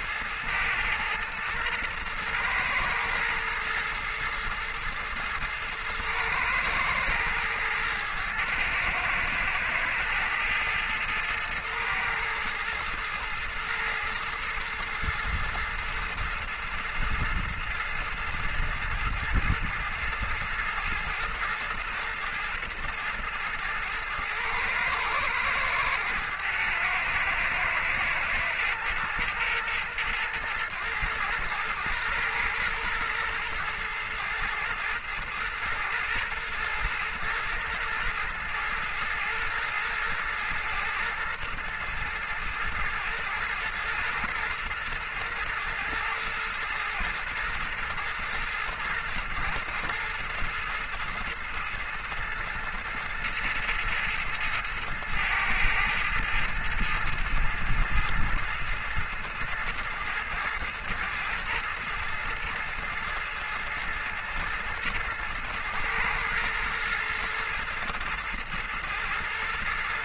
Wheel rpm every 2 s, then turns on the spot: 110, 120, 110, 110, 110, 110, 110, 110, 110, 110, 110, 110, 110, 110, 110, 110, 110, 110, 120, 120, 110, 110, 110, 110, 110, 110, 110, 110, 110, 110, 110, 110, 110, 110, 110.
none